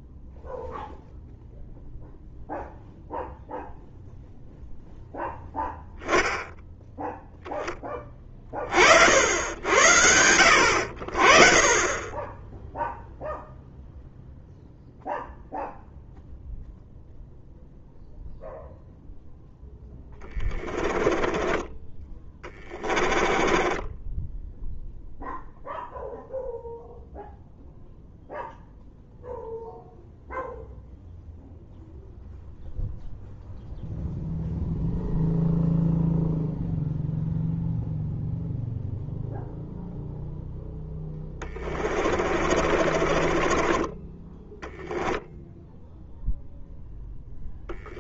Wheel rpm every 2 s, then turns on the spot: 0, 0, 0, 0, 30, 70, 10, 0, 0, 0, 10, 20, 0, 0, 0, 0, 0, 0, 0, 0, 0, 40, 10, 0.
20-24 42-44